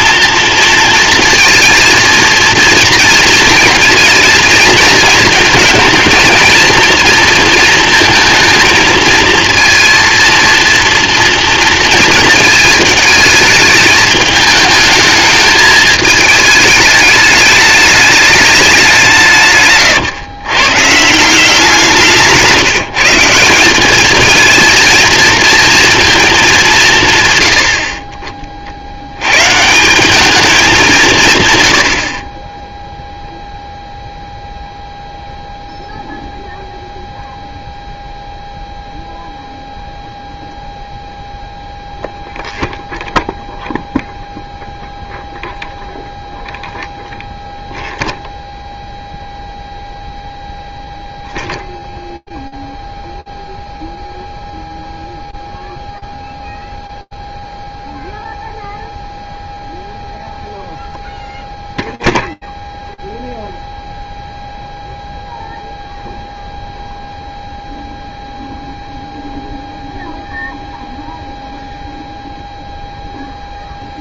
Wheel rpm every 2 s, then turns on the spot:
230, 230, 220, 230, 230, 230, 220, 220, 220, 200, 130, 180, 230, 210, 30, 210, 20, 0, 0, 0, 0, 0, 0, 0, 0, 0, 0, 0, 0, 0, 0, 0, 0, 0, 0, 0, 0.
none